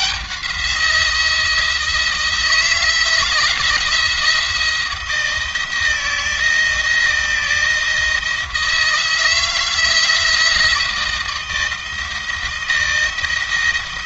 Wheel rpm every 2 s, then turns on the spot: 170, 170, 170, 160, 160, 170, 160.
none